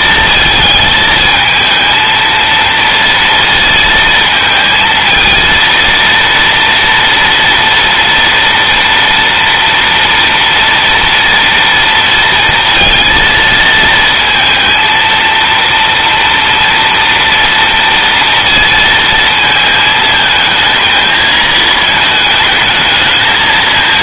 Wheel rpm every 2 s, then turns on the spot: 220, 230, 230, 230, 240, 230, 230, 230, 230, 230, 220, 220.
none